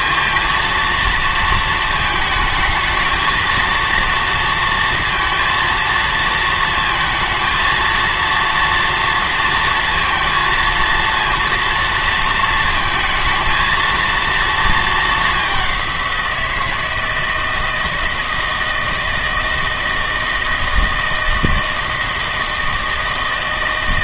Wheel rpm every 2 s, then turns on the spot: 230, 220, 230, 230, 230, 230, 230, 220, 160, 160, 160, 160.
none